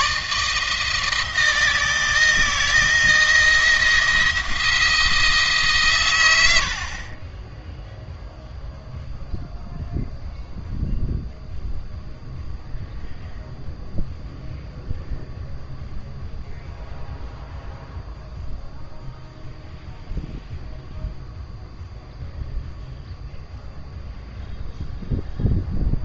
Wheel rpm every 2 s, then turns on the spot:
160, 170, 170, 60, 0, 0, 0, 0, 0, 0, 0, 0, 0.
none